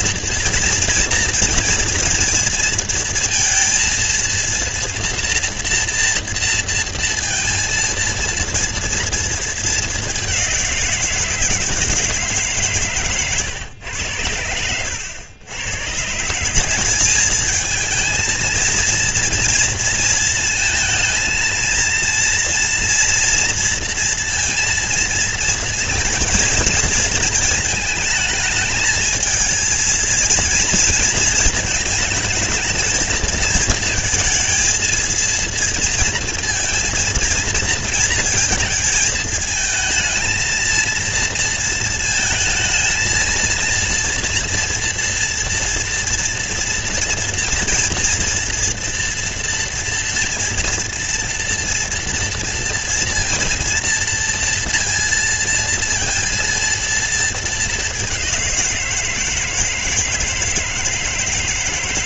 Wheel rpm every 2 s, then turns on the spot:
230, 230, 230, 230, 230, 190, 150, 100, 180, 220, 230, 230, 230, 230, 220, 230, 220, 230, 230, 230, 230, 220, 240, 240, 240, 230, 230, 230, 230, 190, 160.
none